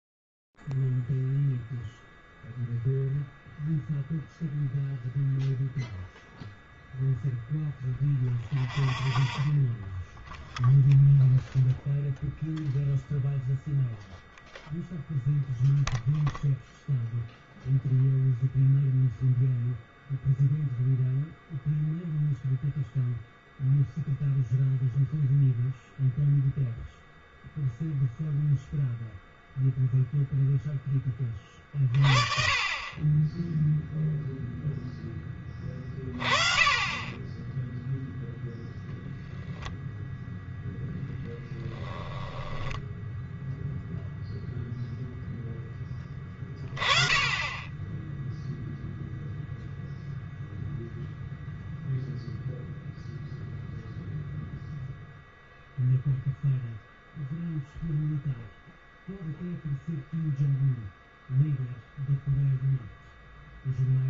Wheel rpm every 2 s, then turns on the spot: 0, 0, 0, 0, 0, 0, 0, 0, 0, 0, 0, 0, 0, 0, 0, 0, 30, 0, 30, 0, 0, 10, 0, 20, 0, 0, 0, 0, 0, 0, 0, 0.
42-44